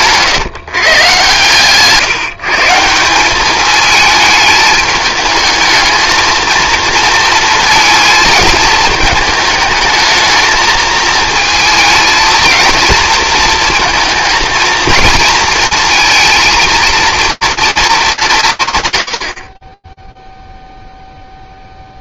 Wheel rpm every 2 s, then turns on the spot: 140, 160, 210, 230, 220, 220, 230, 230, 230, 150, 0.
none